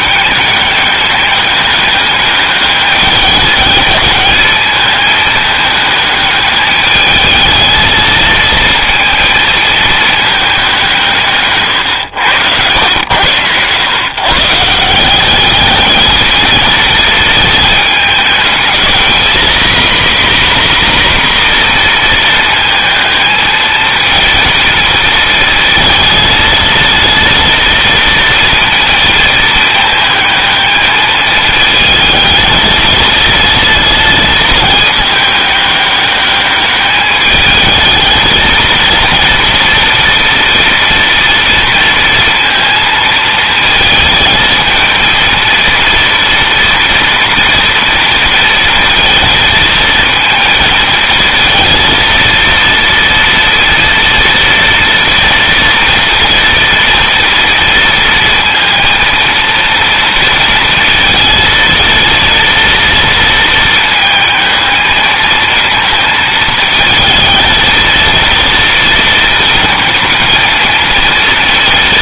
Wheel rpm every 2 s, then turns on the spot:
200, 210, 220, 220, 230, 180, 90, 160, 220, 220, 260, 220, 230, 230, 230, 220, 220, 220, 210, 230, 230, 230, 220, 230, 230, 220, 230, 230, 230, 230, 230, 230, 220, 220, 230, 230.
none